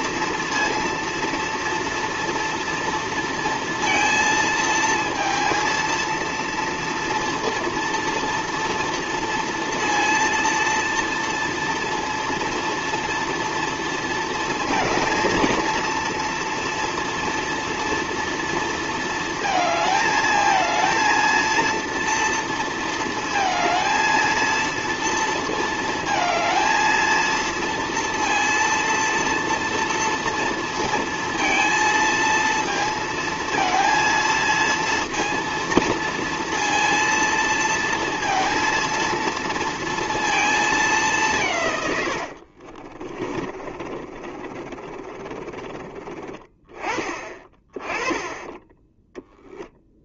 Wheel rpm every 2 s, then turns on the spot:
230, 230, 230, 230, 230, 230, 230, 230, 230, 230, 220, 230, 230, 230, 230, 230, 230, 230, 230, 230, 210, 40, 30, 20, 10.
42-46